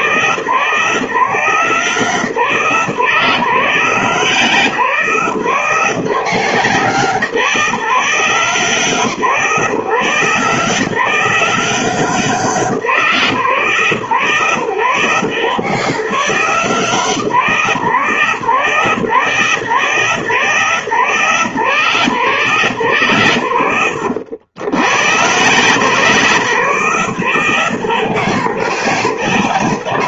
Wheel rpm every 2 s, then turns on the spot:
160, 140, 150, 150, 150, 160, 160, 120, 160, 150, 140, 140, 120, 140, 130.
none